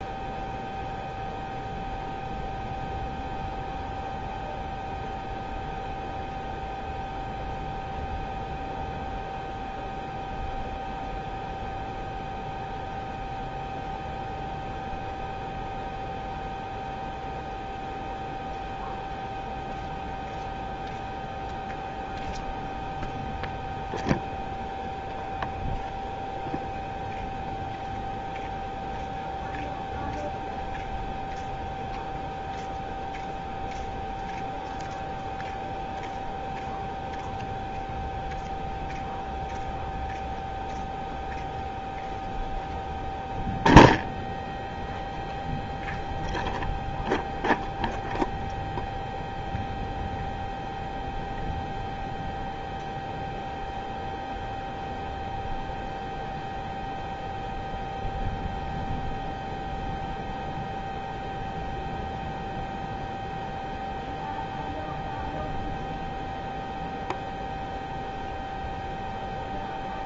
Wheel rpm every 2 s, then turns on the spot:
0, 0, 0, 0, 0, 0, 0, 0, 0, 0, 0, 0, 0, 0, 0, 0, 0, 0, 0, 0, 0, 0, 0, 0, 0, 0, 0, 0, 0, 0, 0, 0, 0, 0, 0.
none